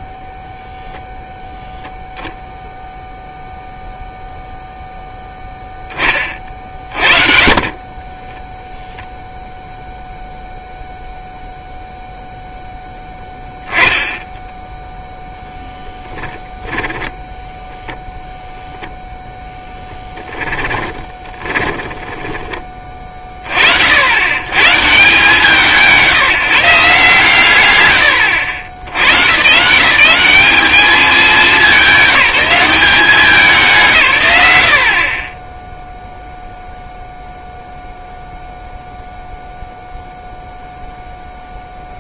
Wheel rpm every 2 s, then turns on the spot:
0, 0, 0, 40, 0, 0, 0, 0, 0, 0, 20, 20, 140, 160, 90, 200, 180, 70, 0, 0, 0.
20-22